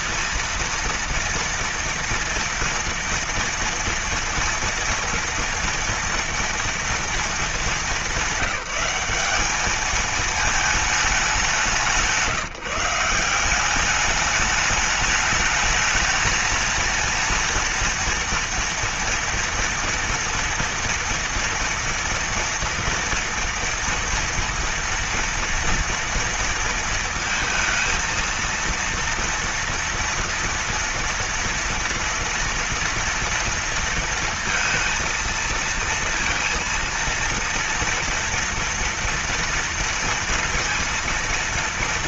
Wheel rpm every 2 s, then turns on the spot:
230, 230, 230, 230, 200, 220, 170, 210, 220, 230, 230, 230, 240, 230, 230, 230, 240, 230, 230, 230, 230.
none